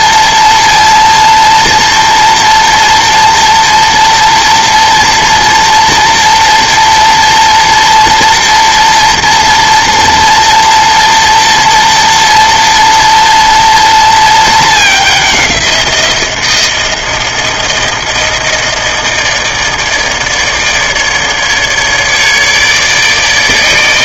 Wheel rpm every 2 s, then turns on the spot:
230, 230, 230, 230, 230, 230, 230, 210, 170, 160, 150, 150.
none